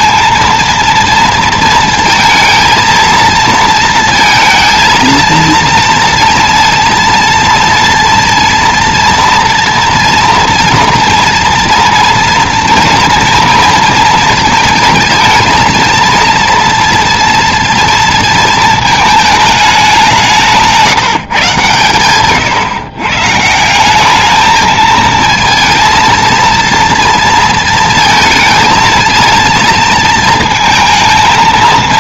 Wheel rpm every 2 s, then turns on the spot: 230, 230, 230, 230, 230, 230, 230, 220, 230, 230, 170, 130, 220, 230, 230, 220.
none